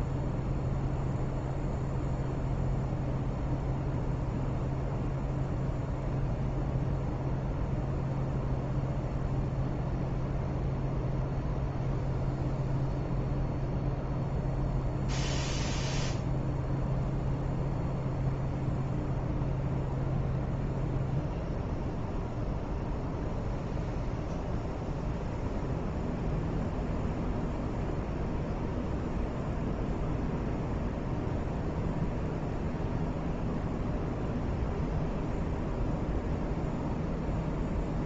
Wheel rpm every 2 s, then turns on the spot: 0, 0, 0, 0, 0, 0, 0, 0, 0, 0, 0, 0, 0, 0, 0, 0, 0, 0, 0.
none